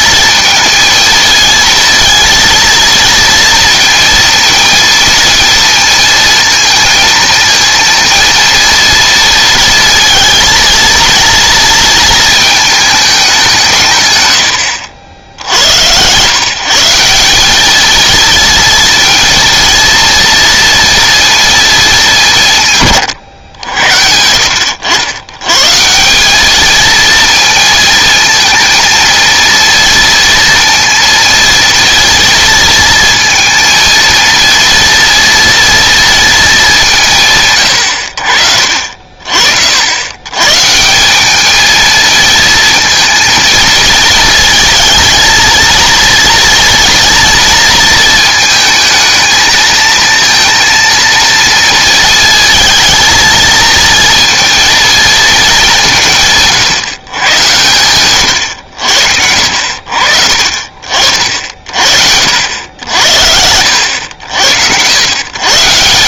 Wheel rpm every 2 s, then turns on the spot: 230, 230, 230, 230, 230, 230, 220, 80, 150, 230, 230, 140, 70, 210, 230, 230, 230, 230, 190, 50, 140, 230, 230, 230, 220, 230, 230, 230, 150, 70, 50, 80, 80.
none